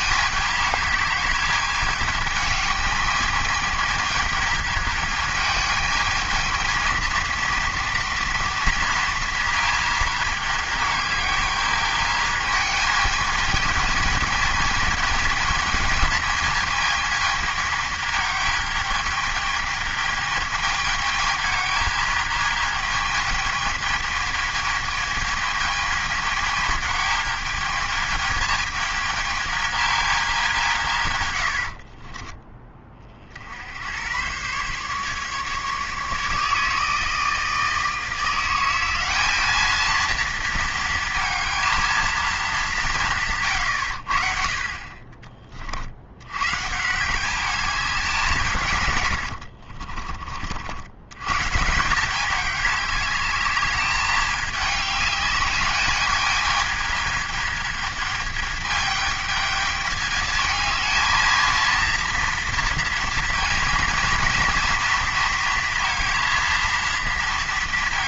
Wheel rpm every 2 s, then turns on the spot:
210, 210, 220, 220, 230, 210, 220, 220, 220, 210, 220, 220, 220, 220, 220, 190, 20, 140, 150, 180, 230, 190, 40, 130, 140, 70, 200, 210, 220, 210, 220, 230, 230, 230.
none